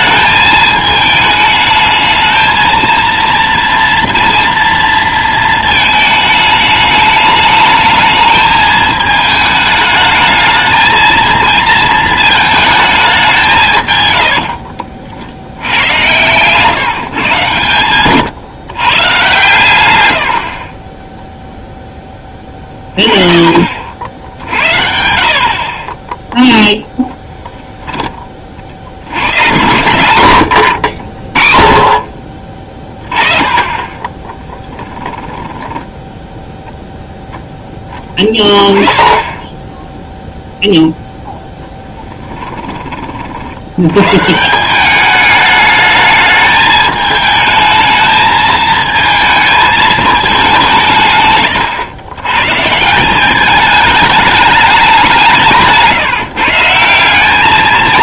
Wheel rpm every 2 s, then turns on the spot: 220, 230, 230, 210, 220, 220, 210, 60, 150, 140, 30, 30, 60, 0, 70, 70, 20, 10, 0, 10, 0, 30, 180, 220, 220, 180, 150, 200, 170.
14-16 34-36